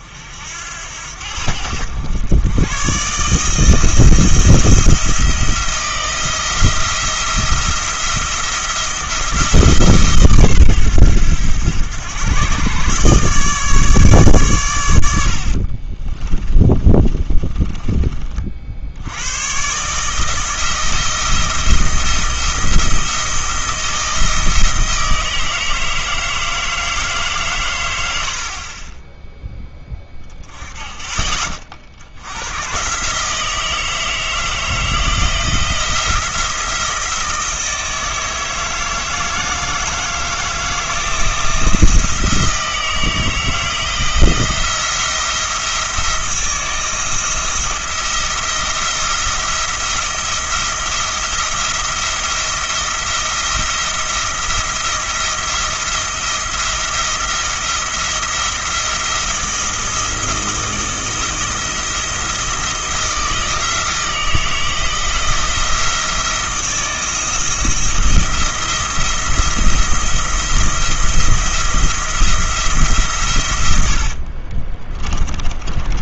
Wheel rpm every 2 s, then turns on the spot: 80, 120, 170, 170, 170, 100, 130, 110, 30, 60, 160, 170, 160, 160, 20, 20, 120, 160, 170, 160, 160, 160, 170, 170, 170, 170, 170, 170, 170, 170, 160, 170, 160, 170, 170, 170, 160, 30.
16-18 74-76